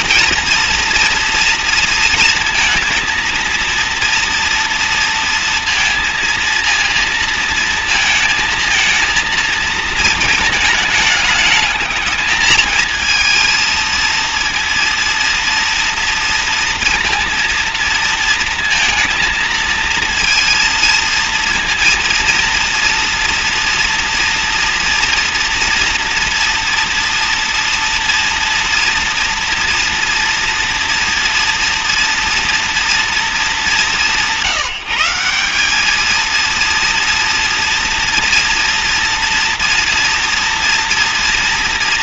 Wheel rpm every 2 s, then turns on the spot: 230, 230, 230, 230, 230, 220, 220, 230, 230, 230, 230, 230, 230, 230, 230, 240, 230, 180, 230, 230, 230.
none